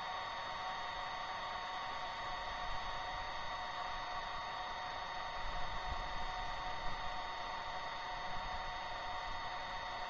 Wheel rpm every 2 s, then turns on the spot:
0, 0, 0, 0, 0.
none